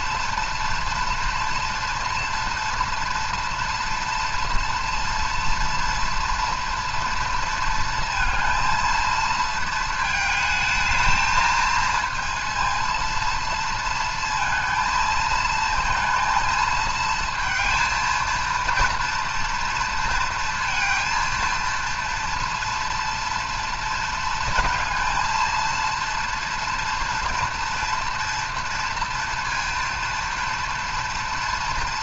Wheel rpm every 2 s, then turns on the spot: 230, 230, 230, 230, 230, 220, 230, 230, 230, 230, 230, 230, 230, 230, 230, 230.
none